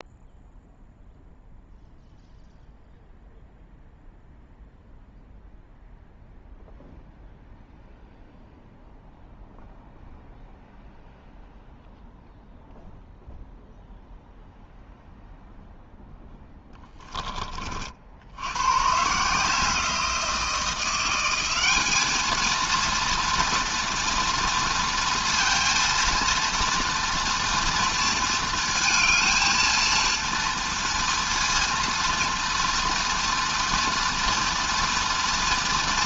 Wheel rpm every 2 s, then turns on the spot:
0, 0, 0, 0, 0, 0, 0, 0, 20, 150, 180, 230, 230, 230, 220, 230, 230, 230.
none